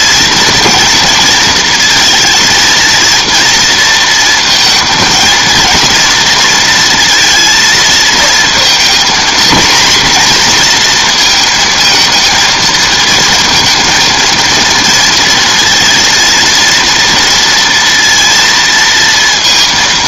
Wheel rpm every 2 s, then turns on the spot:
230, 230, 230, 230, 230, 240, 230, 230, 230, 230.
none